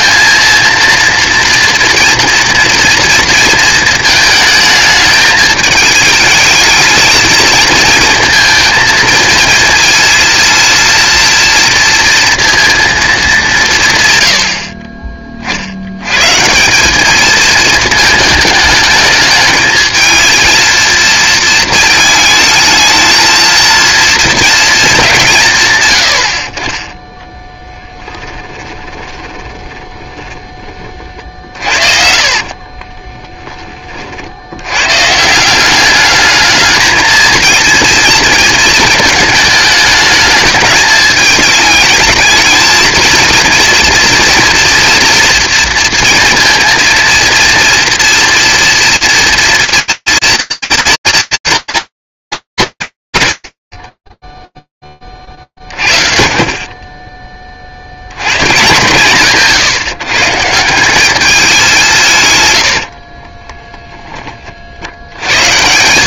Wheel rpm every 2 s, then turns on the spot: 230, 230, 220, 220, 230, 230, 230, 70, 180, 210, 230, 220, 220, 40, 10, 20, 40, 100, 220, 220, 220, 220, 230, 230, 230, 230, 200, 0, 30, 130, 150, 110, 50.
28-30 32-34 62-64